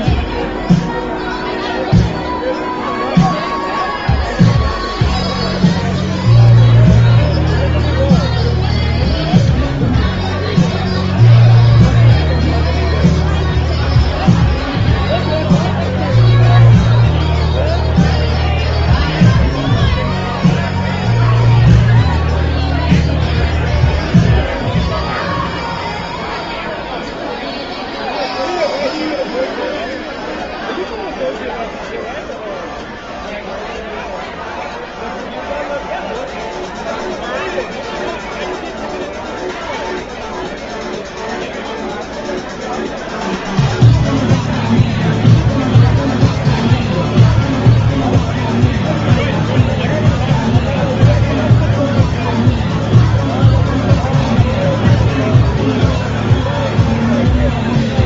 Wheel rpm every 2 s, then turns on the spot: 0, 0, 0, 0, 0, 0, 0, 0, 0, 0, 0, 0, 0, 0, 0, 0, 0, 0, 0, 0, 0, 0, 0, 0, 0, 0, 0, 0, 0.
none